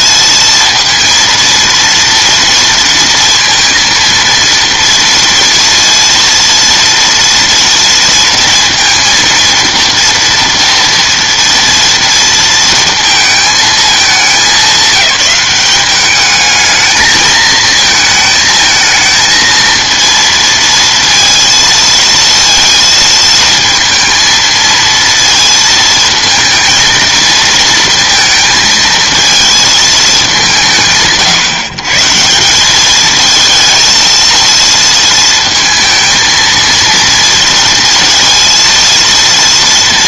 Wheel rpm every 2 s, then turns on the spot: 230, 230, 230, 230, 230, 230, 230, 190, 220, 220, 230, 230, 230, 230, 230, 150, 200, 230, 230, 230.
none